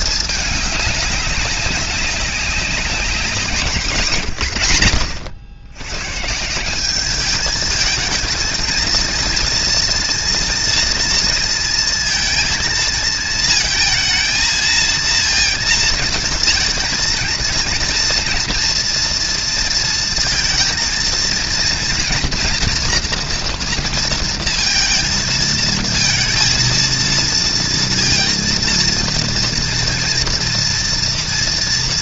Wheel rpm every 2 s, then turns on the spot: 210, 190, 120, 170, 220, 230, 220, 230, 220, 230, 230, 230, 230, 230, 230, 230.
none